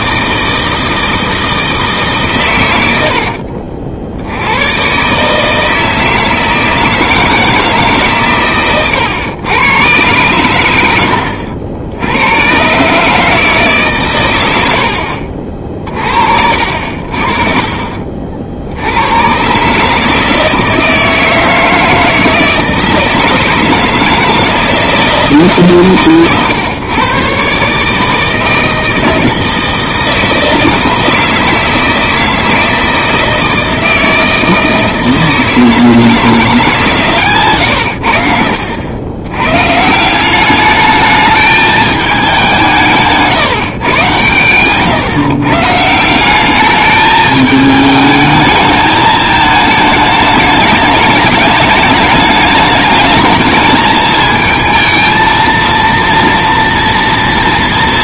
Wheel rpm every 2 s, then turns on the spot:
160, 120, 100, 160, 130, 110, 110, 90, 60, 70, 160, 160, 160, 130, 160, 160, 160, 160, 160, 70, 190, 180, 120, 200, 220, 210, 210, 220, 230.
none